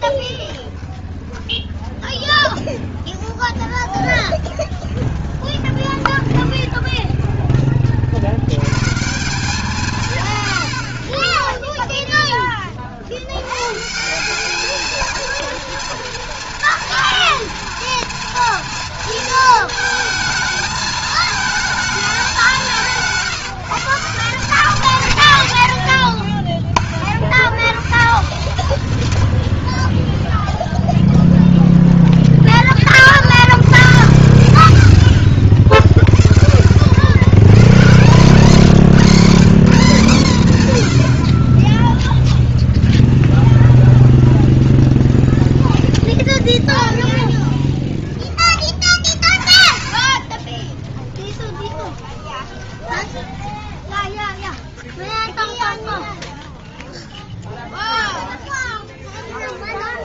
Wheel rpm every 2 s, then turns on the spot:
0, 0, 0, 20, 180, 0, 130, 230, 240, 230, 220, 160, 140, 110, 100, 0, 90, 60, 120, 210, 40, 0, 0, 0, 40, 20, 20, 0, 0, 0.
48-54